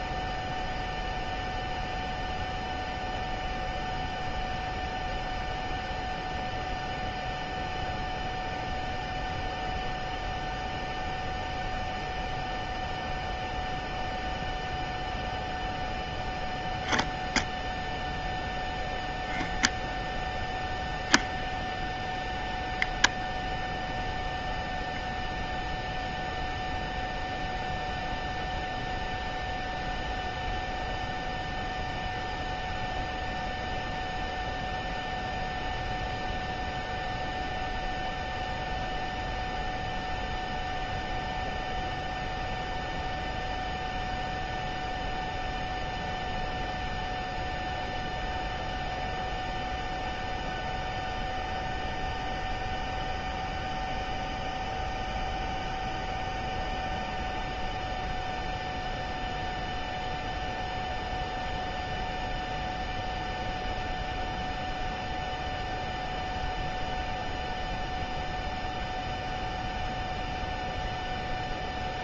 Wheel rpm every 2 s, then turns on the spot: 0, 0, 0, 0, 0, 0, 0, 0, 0, 0, 0, 0, 0, 0, 0, 0, 0, 0, 0, 0, 0, 0, 0, 0, 0, 0, 0, 0, 0, 0, 0, 0, 0, 0, 0, 0.
none